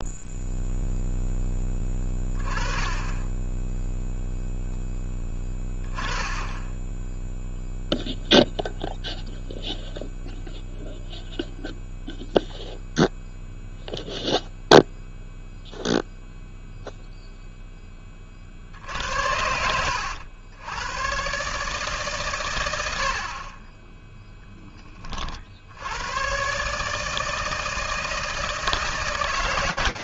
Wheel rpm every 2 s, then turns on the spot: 10, 10, 10, 0, 0, 0, 0, 0, 0, 80, 140, 40, 70, 160, 160.
none